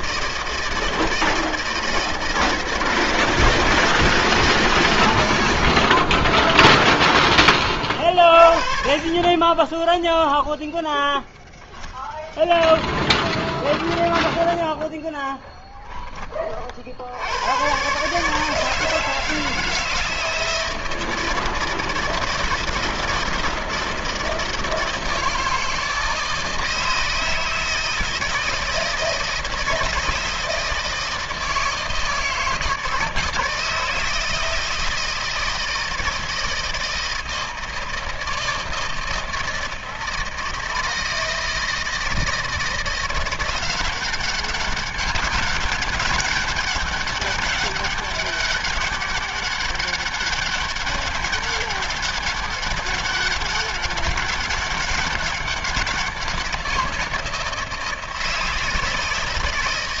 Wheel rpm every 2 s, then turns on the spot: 160, 160, 150, 10, 40, 10, 0, 0, 30, 150, 160, 160, 160, 160, 160, 160, 160, 160, 160, 160, 160, 160, 190, 200, 200, 200, 190, 200, 180, 160.
6-8 10-12